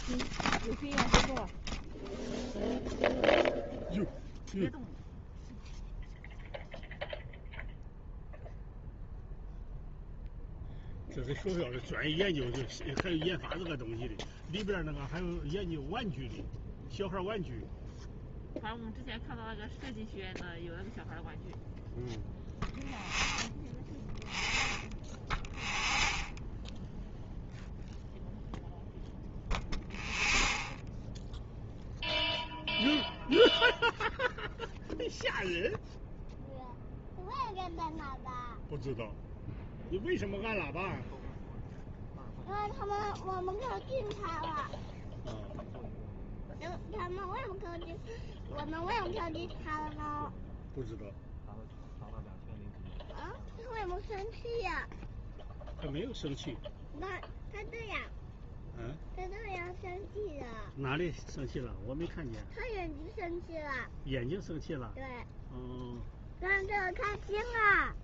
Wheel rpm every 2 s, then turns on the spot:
0, 0, 0, 0, 0, 0, 0, 0, 0, 0, 0, 0, 0, 0, 0, 0, 0, 0, 0, 0, 0, 0, 0, 0, 0, 0, 0, 0, 0, 0, 0, 0, 0, 0.
none